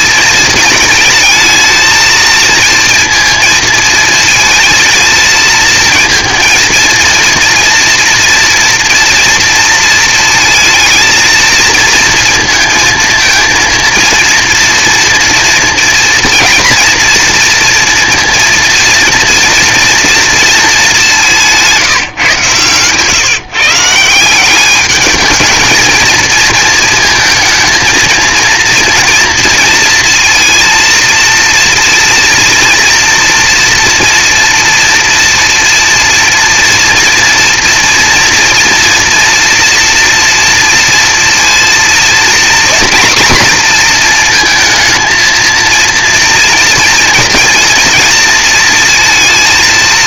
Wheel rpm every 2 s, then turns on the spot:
220, 230, 220, 230, 230, 220, 230, 230, 230, 230, 220, 130, 190, 230, 230, 220, 230, 230, 240, 230, 230, 240, 230, 230, 230.
none